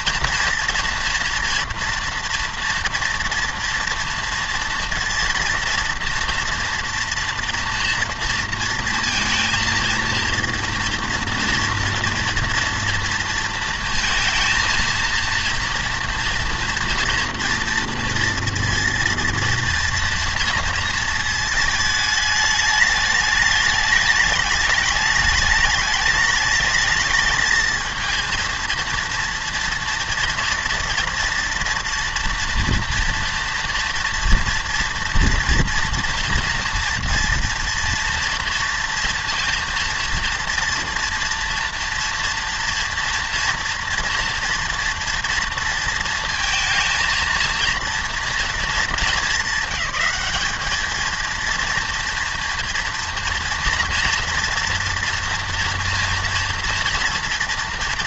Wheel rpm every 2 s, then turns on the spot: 230, 230, 230, 240, 230, 230, 230, 230, 230, 230, 230, 210, 210, 210, 230, 230, 230, 230, 230, 230, 240, 230, 230, 230, 230, 200, 230, 240, 230.
none